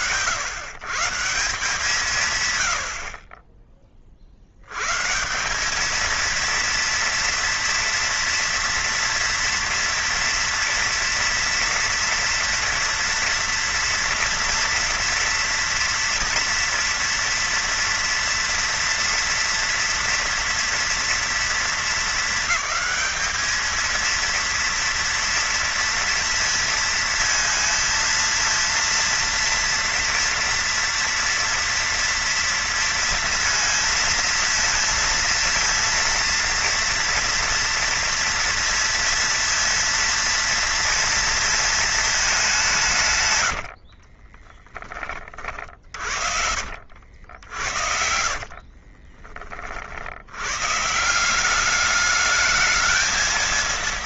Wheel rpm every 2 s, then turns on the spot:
140, 90, 130, 230, 230, 230, 230, 230, 230, 230, 230, 210, 230, 230, 230, 230, 230, 230, 230, 230, 230, 140, 20, 50, 40, 140, 220.
48-50